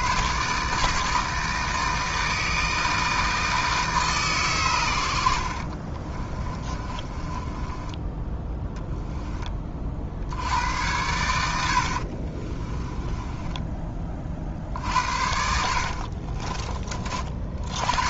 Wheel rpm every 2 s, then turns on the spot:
150, 160, 110, 30, 10, 90, 20, 70, 30.
6-8 12-16